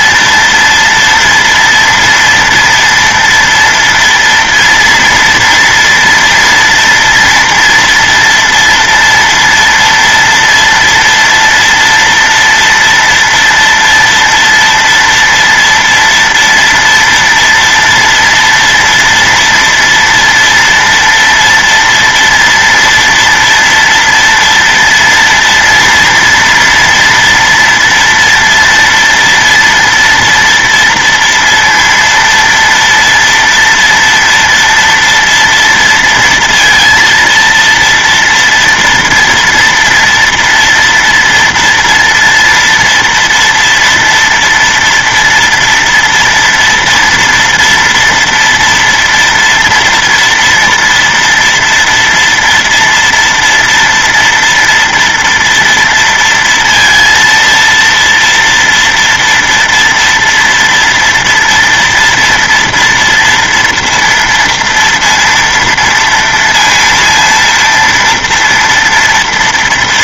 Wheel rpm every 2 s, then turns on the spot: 230, 230, 230, 230, 230, 230, 230, 230, 230, 230, 230, 230, 230, 240, 230, 230, 230, 240, 230, 230, 230, 240, 230, 240, 230, 230, 230, 230, 230, 230, 230, 230, 230, 230, 230.
none